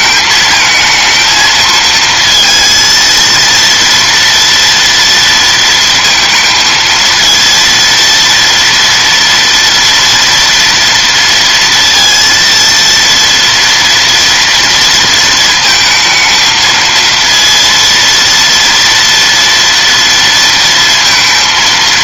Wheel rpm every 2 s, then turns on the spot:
220, 230, 230, 220, 230, 240, 230, 230, 220, 240, 230.
none